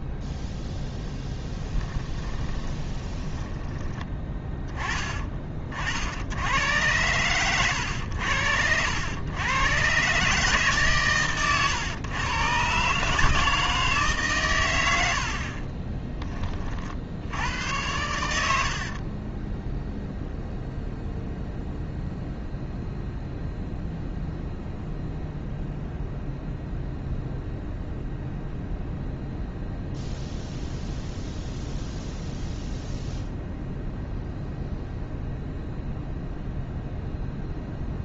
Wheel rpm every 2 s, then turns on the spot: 0, 20, 20, 110, 90, 140, 140, 70, 50, 60, 0, 0, 0, 0, 0, 0, 0, 0, 0.
2-4 18-20